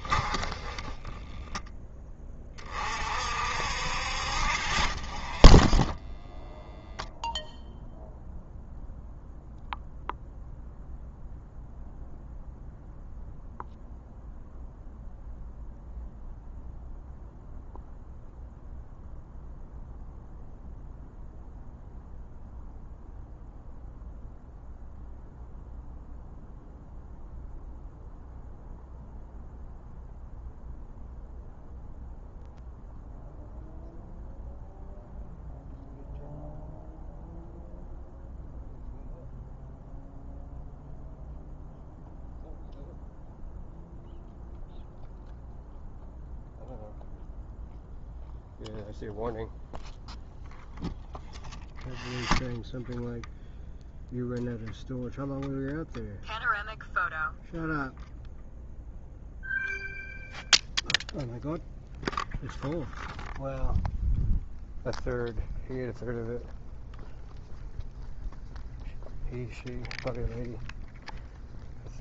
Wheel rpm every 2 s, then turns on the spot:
20, 50, 30, 0, 0, 0, 0, 0, 0, 0, 0, 0, 0, 0, 0, 0, 0, 0, 0, 0, 0, 0, 0, 0, 0, 0, 0, 0, 0, 0, 0, 0, 0, 0, 0, 0.
0-2 4-6